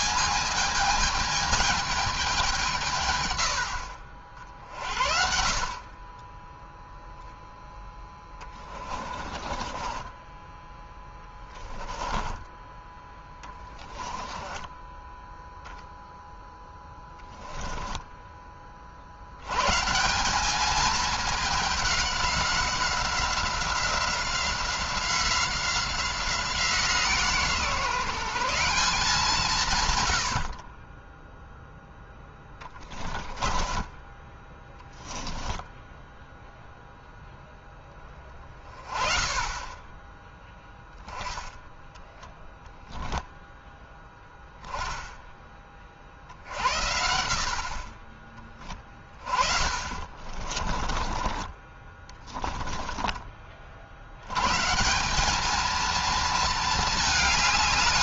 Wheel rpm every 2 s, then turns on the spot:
220, 170, 40, 10, 20, 10, 10, 10, 10, 30, 200, 190, 180, 170, 180, 40, 10, 20, 0, 20, 10, 0, 10, 70, 30, 30, 10, 150, 220.
8-12 14-18 32-36 48-54